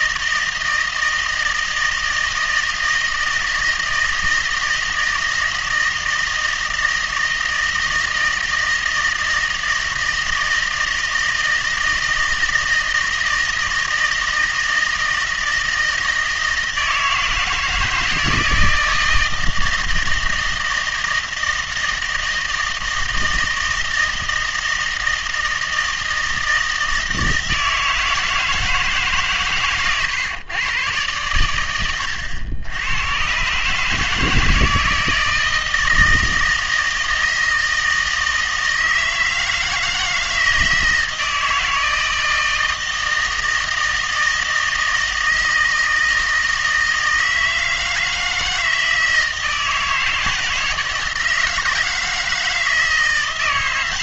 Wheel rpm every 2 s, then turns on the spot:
160, 160, 160, 160, 160, 160, 160, 160, 160, 160, 160, 160, 160, 160, 160, 110, 100, 160, 160, 160, 160, 160, 160, 160, 160, 160, 160.
none